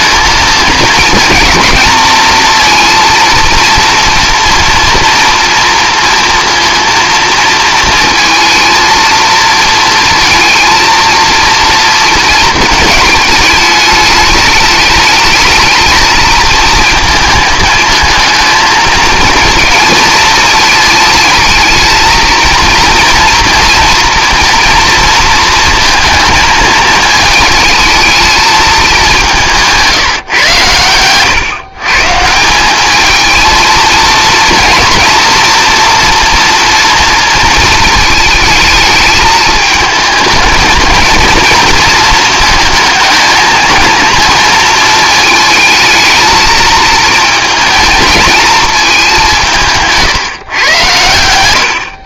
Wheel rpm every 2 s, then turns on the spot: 220, 230, 230, 230, 230, 230, 220, 210, 230, 220, 220, 230, 240, 220, 210, 110, 190, 230, 240, 220, 220, 230, 230, 220, 210, 120.
none